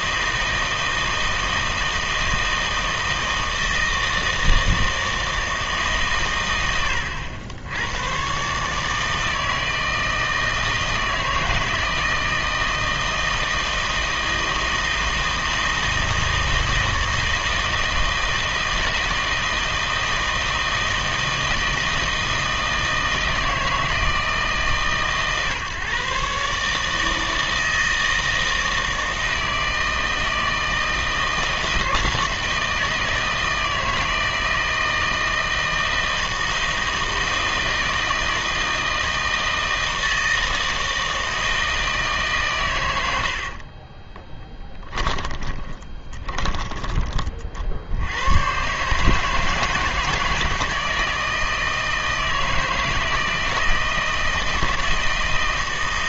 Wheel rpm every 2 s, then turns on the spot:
160, 160, 160, 90, 150, 160, 160, 160, 160, 160, 160, 160, 140, 150, 160, 160, 160, 160, 160, 160, 160, 120, 10, 20, 140, 160, 160, 160.
44-46